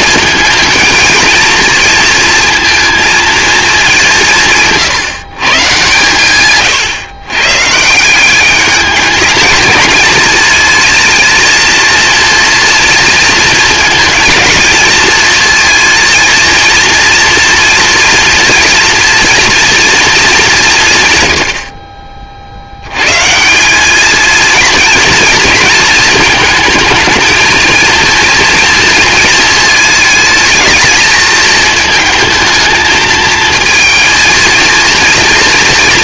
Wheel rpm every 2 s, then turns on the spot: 220, 230, 150, 130, 200, 220, 230, 230, 230, 230, 190, 60, 230, 220, 230, 220, 230, 230.
none